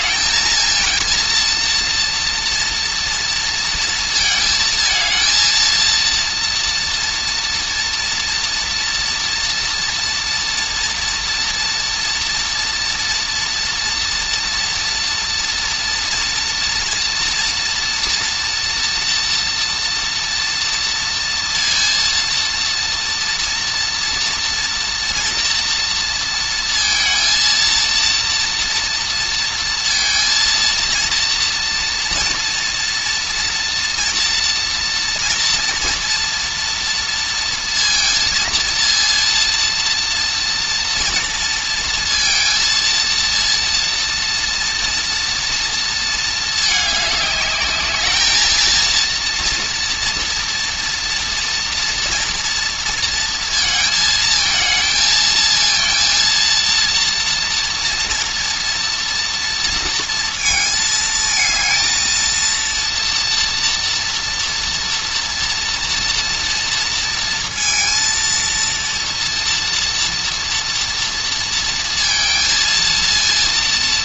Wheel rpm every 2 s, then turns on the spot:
230, 240, 230, 230, 230, 240, 230, 240, 240, 230, 230, 230, 230, 230, 230, 230, 230, 230, 230, 230, 230, 230, 230, 220, 220, 230, 230, 220, 230, 230, 220, 230, 240, 230, 230, 230, 230.
none